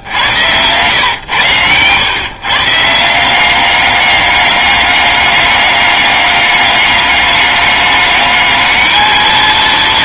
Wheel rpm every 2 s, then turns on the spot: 110, 160, 200, 200, 220.
none